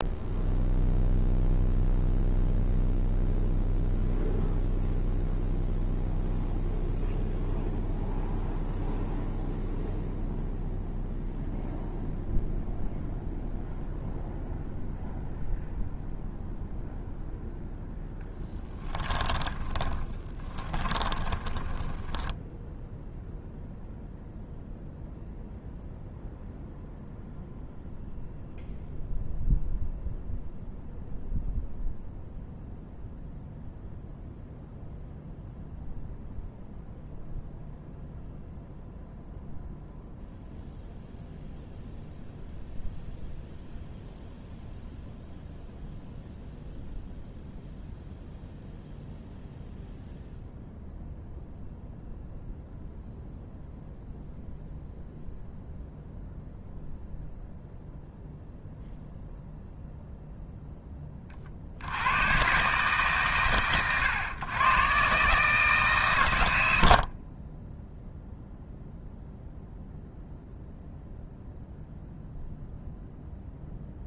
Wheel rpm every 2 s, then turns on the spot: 0, 0, 0, 0, 0, 0, 0, 0, 0, 10, 20, 0, 0, 0, 0, 0, 0, 0, 0, 0, 0, 0, 0, 0, 0, 0, 0, 0, 0, 0, 10, 140, 130, 90, 0, 0, 0.
18-22